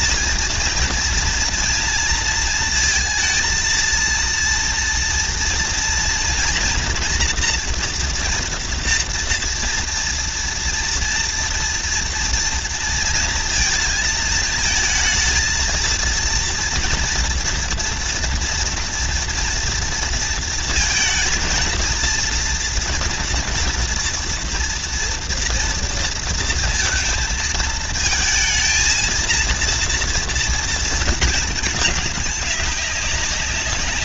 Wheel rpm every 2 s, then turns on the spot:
230, 230, 230, 240, 230, 230, 230, 220, 230, 230, 230, 230, 230, 230, 220, 230, 200.
none